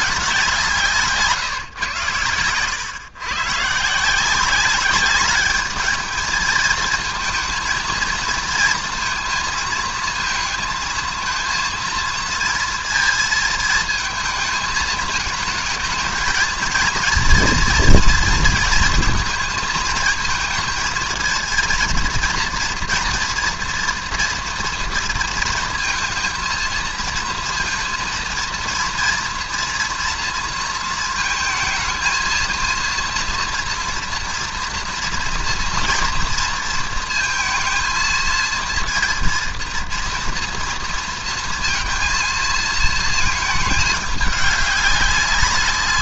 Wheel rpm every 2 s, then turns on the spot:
180, 110, 190, 220, 230, 220, 230, 220, 220, 220, 220, 230, 230, 230, 230, 230, 230, 240, 230, 230, 230, 230, 210.
none